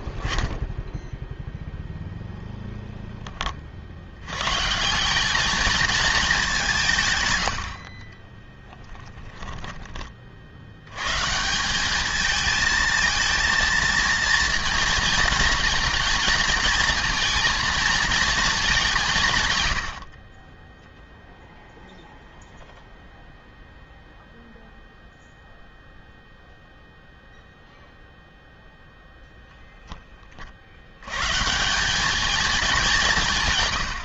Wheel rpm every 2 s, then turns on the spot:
0, 60, 220, 50, 20, 170, 230, 230, 230, 110, 0, 0, 0, 0, 10, 170, 120.
8-10 18-20